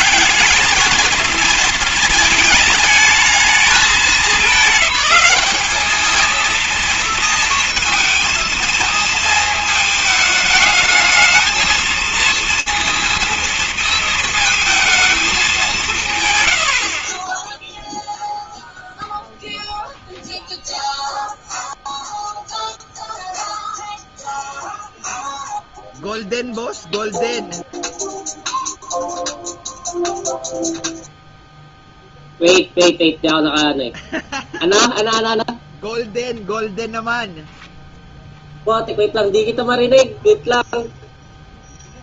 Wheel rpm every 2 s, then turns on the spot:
210, 220, 210, 220, 230, 210, 230, 220, 130, 0, 0, 0, 0, 0, 0, 0, 0, 0, 0, 0, 0.
none